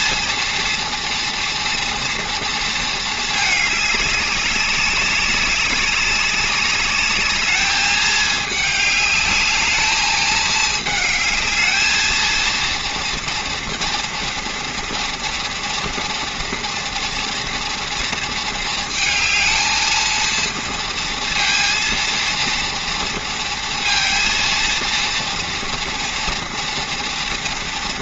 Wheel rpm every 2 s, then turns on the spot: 230, 230, 190, 200, 210, 220, 230, 230, 230, 230, 230, 230, 230, 230.
none